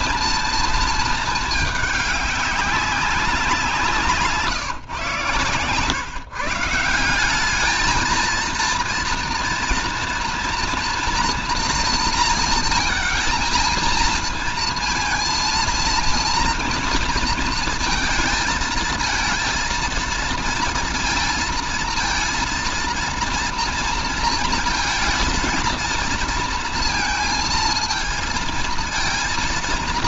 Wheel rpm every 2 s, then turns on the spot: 230, 200, 140, 160, 230, 240, 230, 230, 230, 220, 230, 230, 230, 230, 230.
none